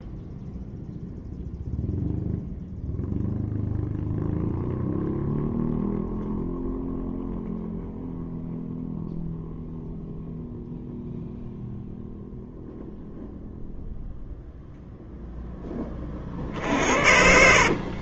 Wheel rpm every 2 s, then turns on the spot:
0, 0, 0, 0, 0, 0, 0, 0, 50.
16-18